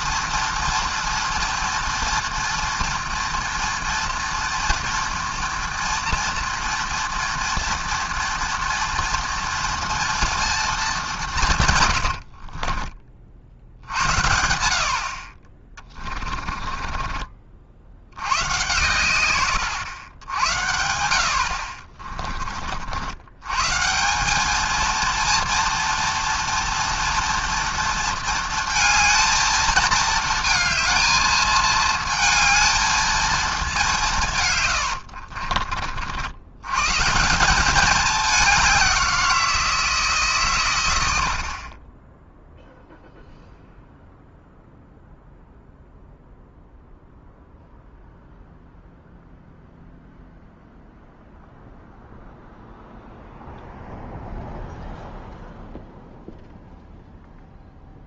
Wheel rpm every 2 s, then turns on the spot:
230, 230, 230, 230, 240, 210, 40, 70, 30, 120, 80, 60, 230, 230, 230, 220, 220, 110, 140, 190, 110, 0, 0, 0, 0, 0, 0, 0, 0.
12-14 16-18 34-36